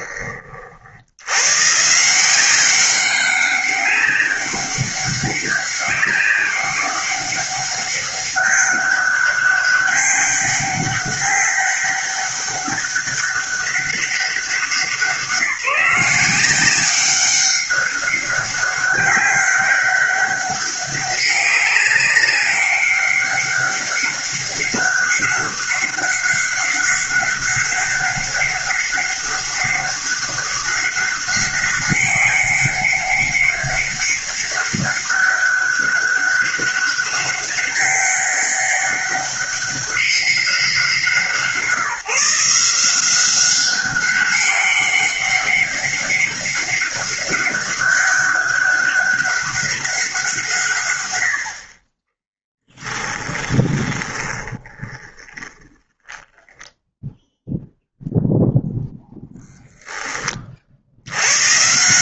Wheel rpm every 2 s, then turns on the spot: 70, 190, 200, 200, 200, 200, 200, 170, 190, 200, 200, 200, 200, 200, 200, 200, 200, 200, 200, 200, 180, 180, 200, 200, 200, 100, 20, 20, 0, 0, 90.
52-56